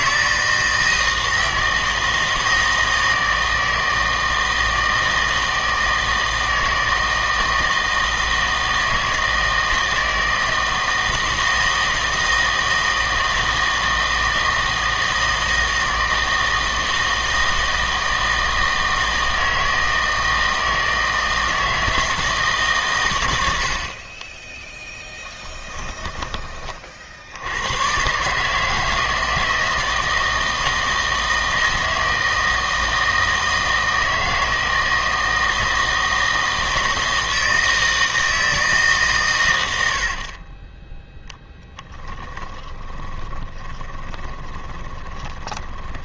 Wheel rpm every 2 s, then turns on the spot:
160, 160, 160, 160, 160, 160, 160, 160, 160, 160, 160, 140, 10, 40, 160, 160, 160, 160, 160, 150, 20, 20, 20.
42-46